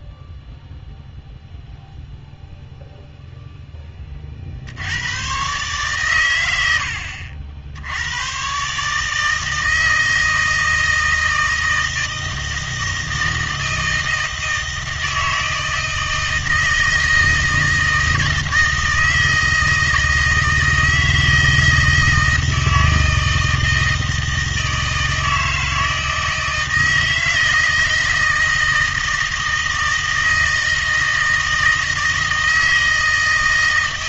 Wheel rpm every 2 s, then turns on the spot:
0, 0, 70, 80, 140, 160, 160, 160, 160, 160, 160, 160, 160, 160, 160, 160, 160.
none